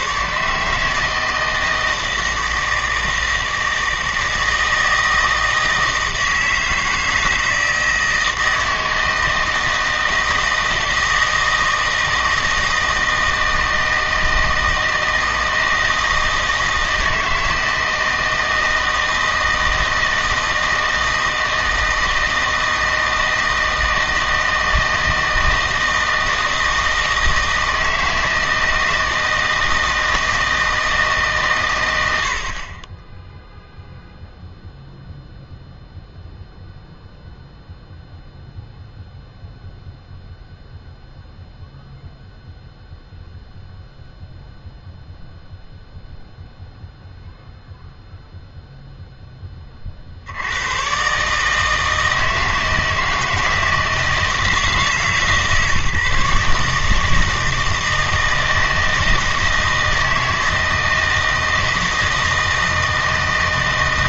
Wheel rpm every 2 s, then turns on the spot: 150, 160, 160, 160, 160, 160, 160, 160, 160, 160, 160, 160, 160, 160, 160, 160, 40, 0, 0, 0, 0, 0, 0, 0, 0, 110, 160, 160, 150, 160, 160, 160.
none